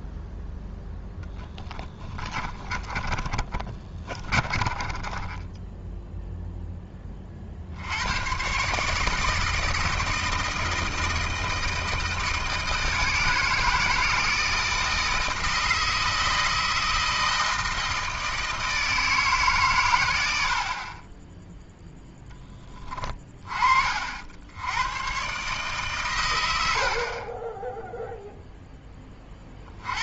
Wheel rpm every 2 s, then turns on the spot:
0, 30, 30, 10, 140, 160, 160, 160, 160, 160, 50, 20, 90, 60, 10.
2-6